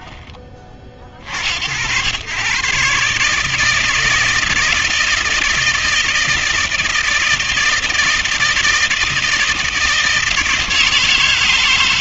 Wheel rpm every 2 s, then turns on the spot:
40, 150, 160, 160, 160, 160.
none